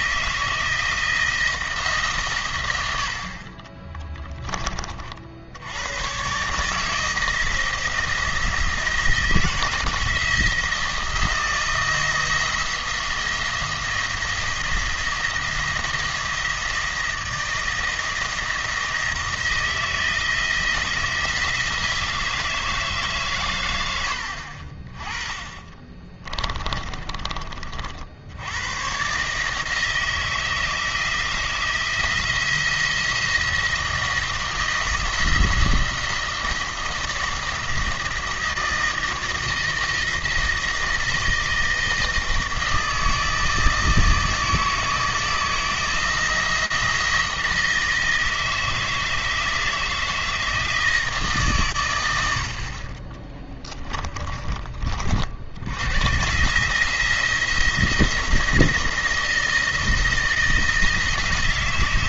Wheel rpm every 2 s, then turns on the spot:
170, 90, 30, 160, 160, 170, 170, 170, 160, 160, 160, 150, 40, 30, 120, 160, 170, 160, 170, 160, 160, 160, 160, 170, 160, 160, 40, 40, 160, 170, 170.
26-28